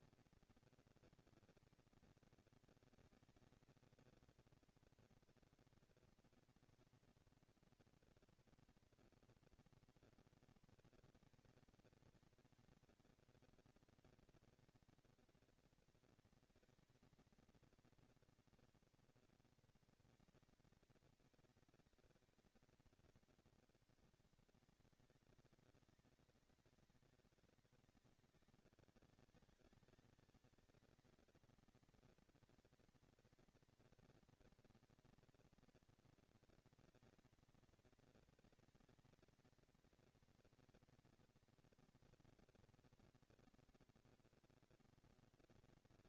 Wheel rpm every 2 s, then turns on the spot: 230, 220, 230, 230, 230, 230, 230, 230, 230, 230, 220, 220, 200, 200, 190, 220, 240, 230, 220, 220, 230, 230, 230.
none